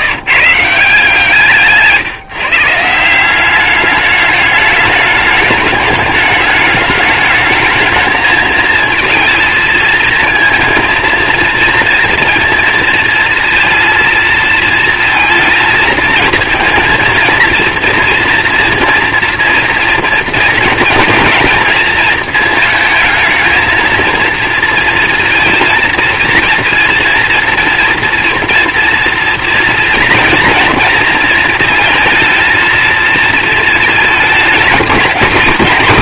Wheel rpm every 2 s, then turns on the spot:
170, 180, 210, 210, 230, 230, 230, 230, 230, 230, 230, 230, 230, 230, 230, 230, 230, 230.
none